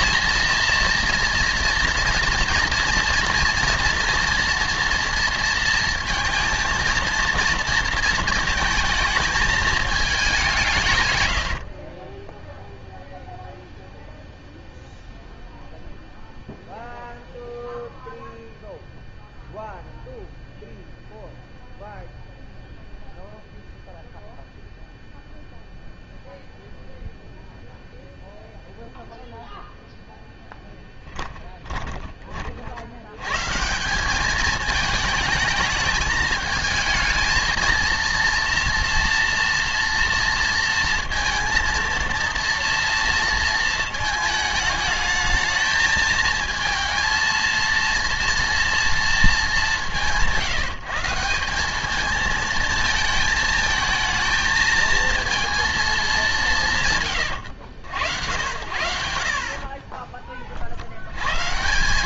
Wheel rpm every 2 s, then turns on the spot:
230, 230, 230, 230, 230, 170, 0, 0, 0, 0, 0, 0, 0, 0, 0, 10, 50, 210, 220, 230, 230, 230, 220, 220, 230, 160, 230, 220, 210, 80, 50.
none